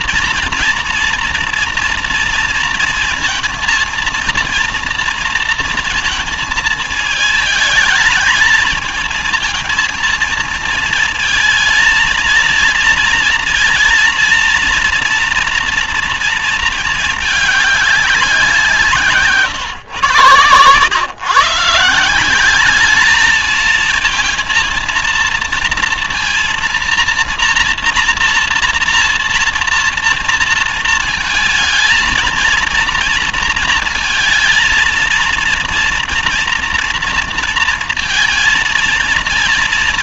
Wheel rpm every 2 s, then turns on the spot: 230, 230, 230, 230, 220, 230, 230, 230, 230, 180, 110, 190, 230, 230, 240, 230, 230, 220, 230, 230.
none